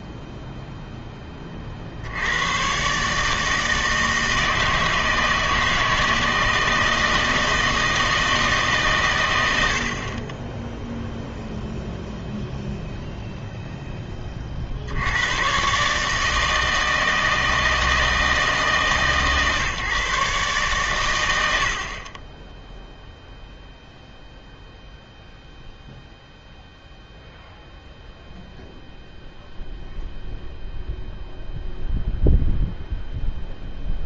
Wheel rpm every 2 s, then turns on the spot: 0, 120, 160, 160, 140, 0, 0, 50, 160, 150, 120, 0, 0, 0, 0, 0, 0.
none